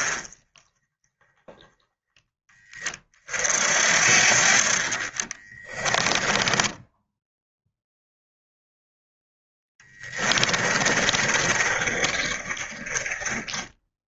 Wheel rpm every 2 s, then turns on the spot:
20, 30, 40, 10, 0, 30, 30.
4-8 10-14